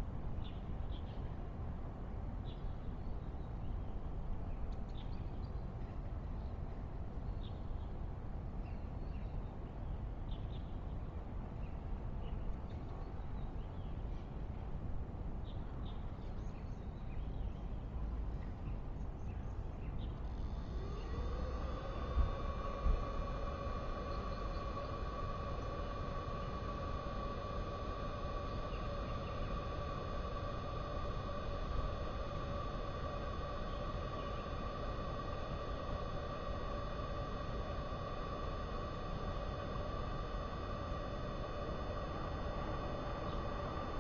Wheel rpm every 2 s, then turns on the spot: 0, 0, 0, 0, 0, 0, 0, 0, 0, 0, 0, 0, 0, 0, 0, 0, 0, 0, 0, 0, 0, 0.
none